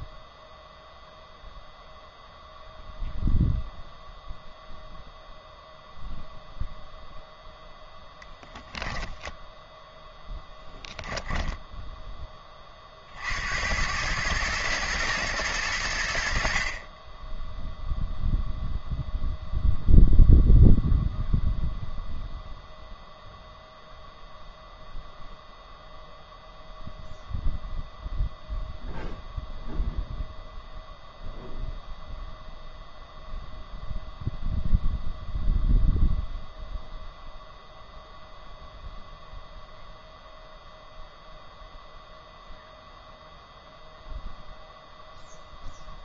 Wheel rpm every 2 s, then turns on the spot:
0, 0, 0, 0, 0, 0, 30, 110, 50, 0, 0, 0, 0, 0, 0, 0, 0, 0, 0, 0, 0, 0, 0.
none